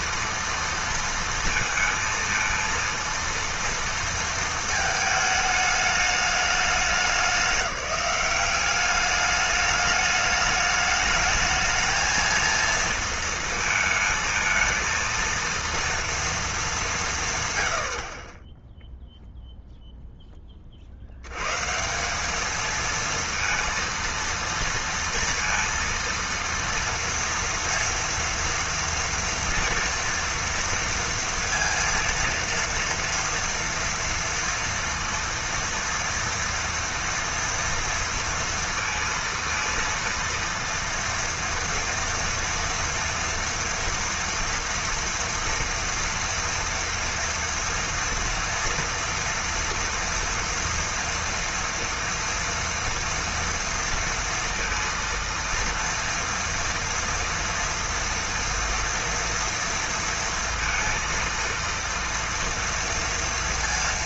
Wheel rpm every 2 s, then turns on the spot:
230, 230, 220, 210, 200, 210, 230, 220, 200, 0, 40, 220, 230, 230, 230, 230, 230, 230, 230, 230, 230, 230, 230, 230, 230, 230, 230, 230, 230, 230, 230, 230.
none